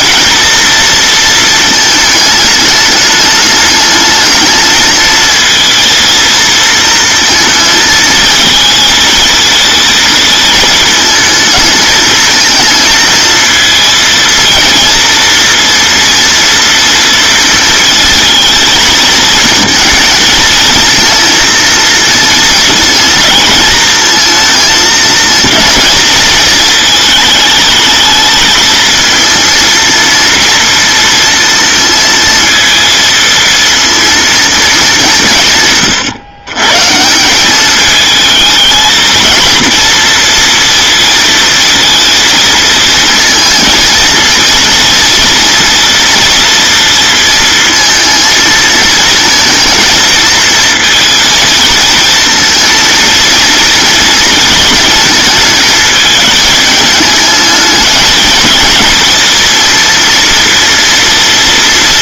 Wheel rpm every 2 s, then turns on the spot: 230, 210, 220, 230, 220, 220, 220, 230, 230, 220, 230, 230, 220, 230, 220, 230, 230, 210, 150, 220, 230, 230, 230, 230, 230, 230, 230, 220, 210, 230, 240.
none